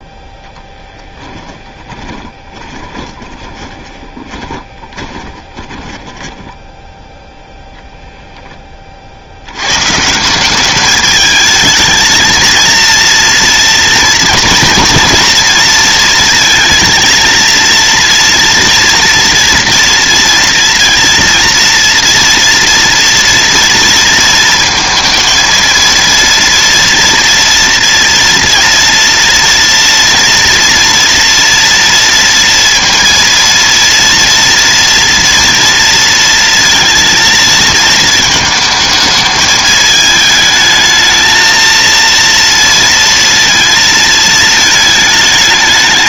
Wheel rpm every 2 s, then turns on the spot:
10, 20, 20, 10, 10, 190, 230, 230, 220, 230, 230, 230, 230, 230, 230, 240, 230, 230, 230, 220, 220, 230, 220.
2-8